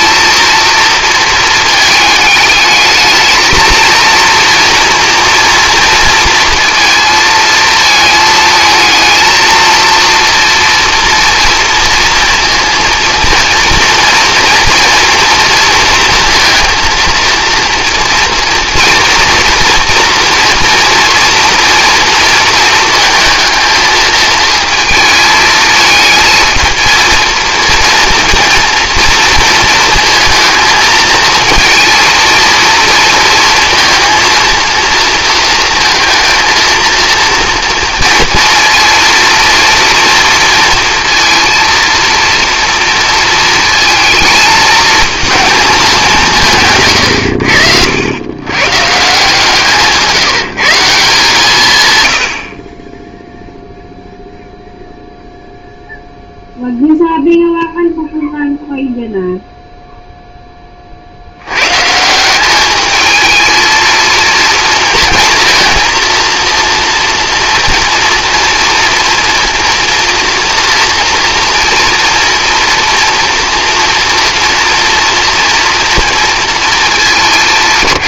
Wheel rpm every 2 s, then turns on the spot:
230, 210, 230, 230, 220, 230, 230, 230, 230, 230, 230, 220, 220, 230, 230, 220, 230, 230, 230, 240, 230, 230, 220, 150, 130, 160, 40, 0, 0, 0, 30, 210, 230, 230, 230, 230, 230, 230, 220.
none